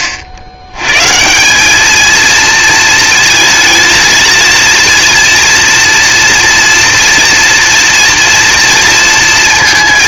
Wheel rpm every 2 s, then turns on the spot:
100, 230, 230, 230, 230.
none